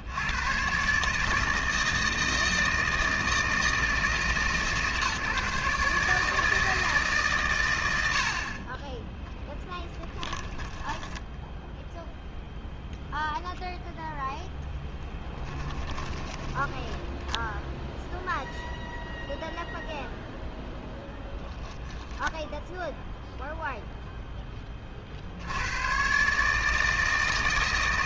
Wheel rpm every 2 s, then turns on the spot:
160, 160, 150, 110, 10, 10, 0, 10, 0, 0, 10, 0, 80, 160.
8-12 14-16